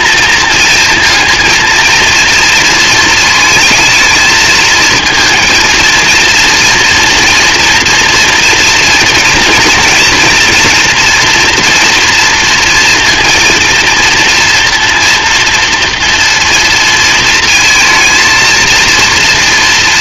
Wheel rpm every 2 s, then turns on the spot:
230, 230, 220, 230, 230, 230, 230, 230, 230, 230.
none